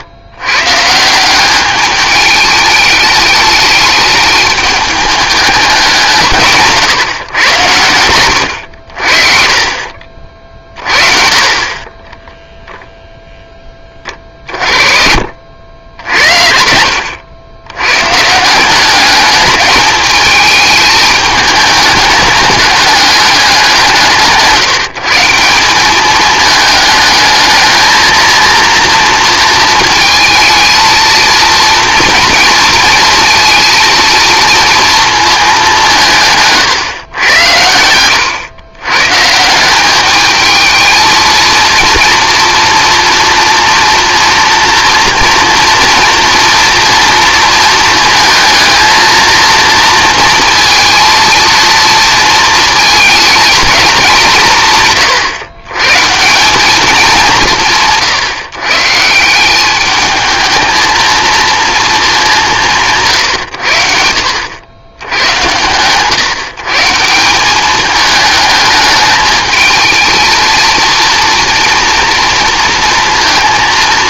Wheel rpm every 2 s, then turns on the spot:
140, 210, 210, 150, 70, 40, 0, 40, 70, 180, 210, 210, 150, 210, 230, 230, 230, 230, 140, 120, 220, 230, 240, 230, 220, 230, 230, 150, 200, 140, 220, 180, 100, 150, 220, 230, 230.
14-18